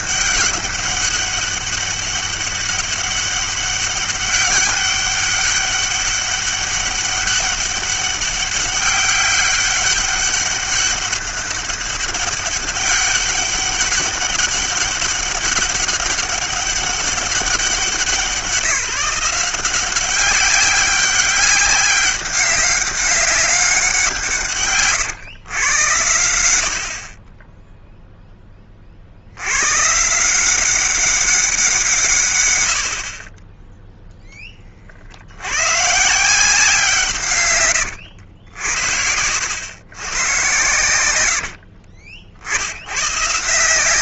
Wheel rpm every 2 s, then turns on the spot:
200, 200, 200, 200, 200, 200, 200, 200, 200, 170, 190, 200, 130, 70, 30, 190, 70, 40, 170, 80, 110, 90.
40-42